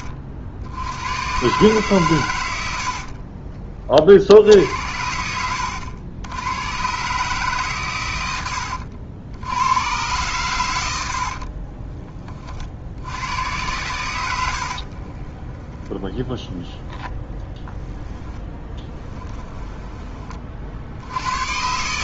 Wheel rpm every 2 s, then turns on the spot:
70, 90, 70, 110, 90, 100, 40, 70, 10, 10, 50.
14-20